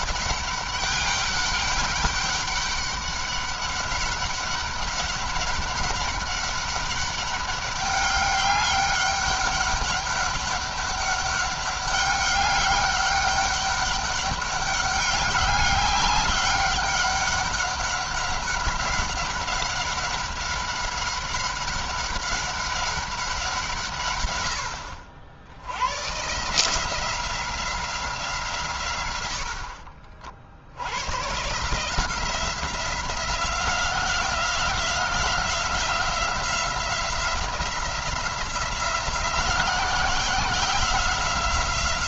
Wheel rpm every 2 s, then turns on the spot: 200, 190, 200, 200, 200, 200, 200, 200, 200, 200, 190, 200, 80, 160, 130, 80, 180, 180, 180, 180, 180.
none